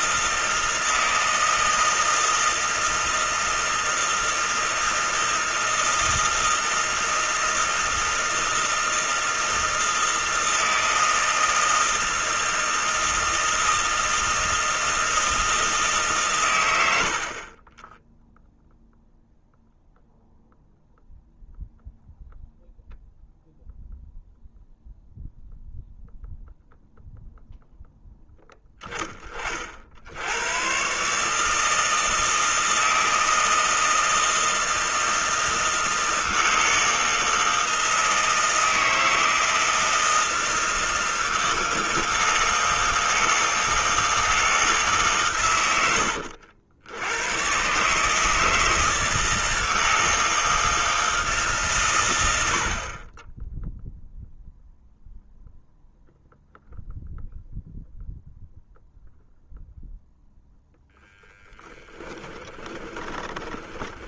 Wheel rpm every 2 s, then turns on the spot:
160, 160, 160, 160, 160, 160, 160, 160, 100, 0, 0, 0, 0, 0, 10, 130, 160, 160, 160, 160, 160, 160, 150, 80, 160, 160, 60, 0, 0, 0, 0, 20.
62-64